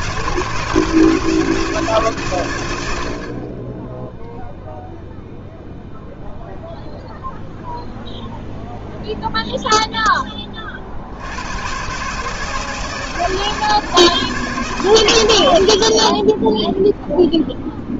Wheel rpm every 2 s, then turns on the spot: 160, 90, 0, 0, 0, 70, 160, 120, 0.
none